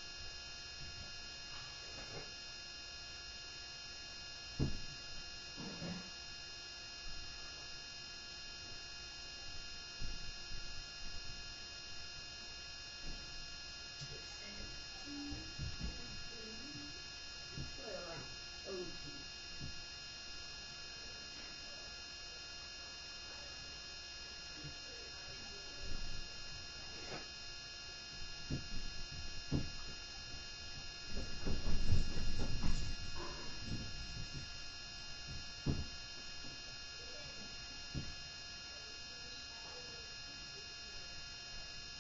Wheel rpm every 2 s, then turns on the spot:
0, 0, 0, 0, 0, 0, 0, 0, 0, 0, 0, 0, 0, 0, 0, 0, 0, 0, 0, 0, 0.
none